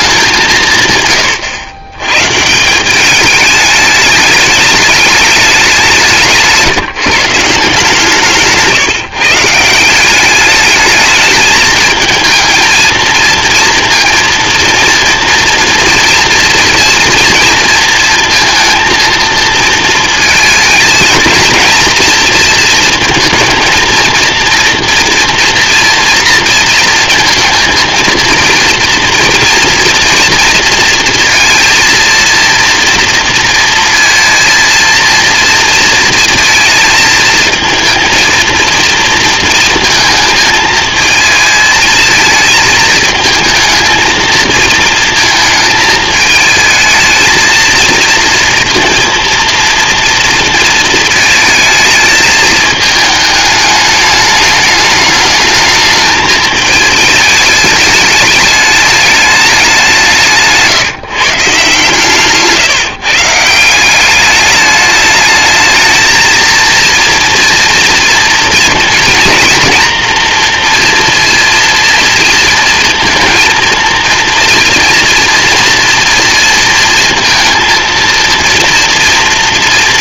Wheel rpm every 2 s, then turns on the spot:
170, 170, 210, 160, 150, 210, 230, 230, 230, 230, 230, 230, 230, 230, 230, 230, 230, 230, 230, 230, 220, 220, 220, 220, 230, 230, 220, 210, 220, 210, 150, 160, 210, 230, 230, 230, 230, 240, 230, 230.
none